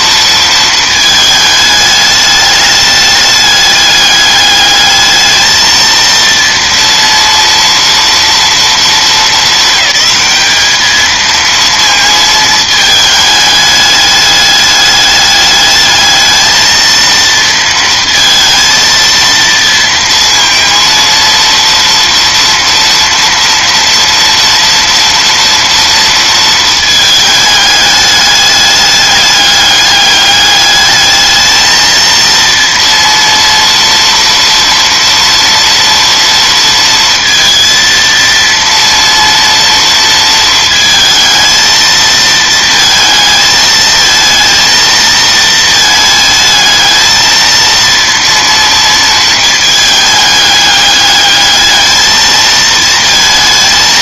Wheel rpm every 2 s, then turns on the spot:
220, 210, 210, 230, 230, 220, 220, 210, 220, 230, 230, 230, 230, 220, 210, 210, 230, 230, 230, 230, 230, 220, 230, 220, 230, 210, 220.
none